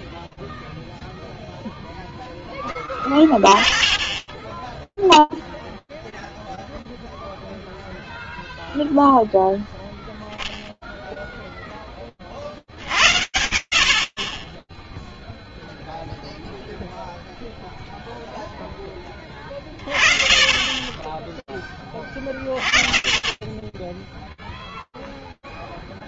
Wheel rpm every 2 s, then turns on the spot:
10, 10, 0, 0, 10, 110, 0, 0, 20, 20, 20, 0, 0.
none